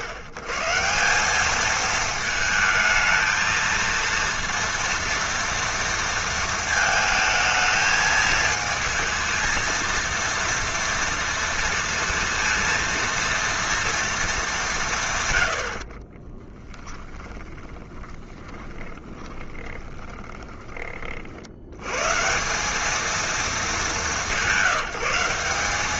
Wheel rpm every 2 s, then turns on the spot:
140, 220, 230, 230, 220, 230, 230, 200, 10, 20, 30, 190, 180.
16-22